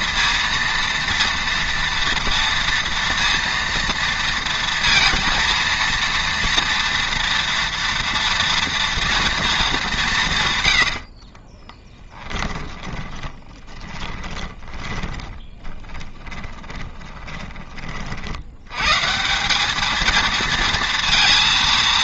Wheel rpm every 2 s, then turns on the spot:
230, 230, 230, 230, 230, 120, 20, 20, 20, 90, 230.
10-18